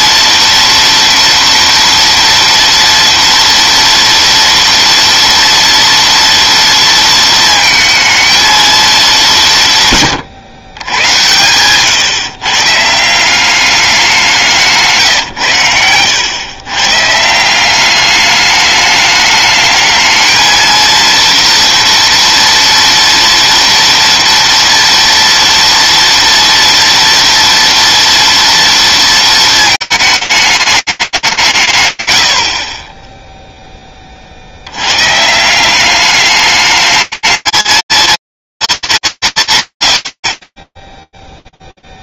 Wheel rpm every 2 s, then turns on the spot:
230, 230, 230, 230, 210, 100, 160, 170, 130, 210, 230, 230, 230, 230, 230, 210, 30, 110, 210, 220, 20.
none